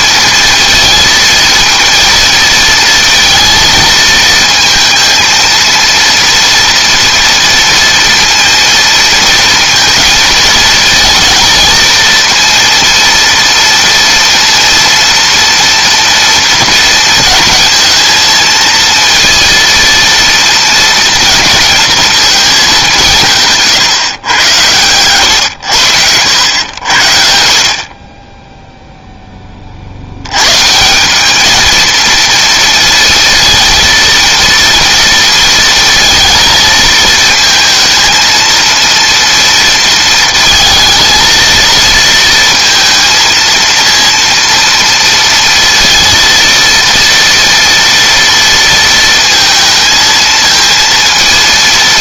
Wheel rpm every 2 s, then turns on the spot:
230, 230, 230, 240, 230, 220, 230, 230, 230, 230, 230, 190, 100, 90, 0, 160, 230, 230, 230, 230, 230, 230, 230, 230, 230, 230.
none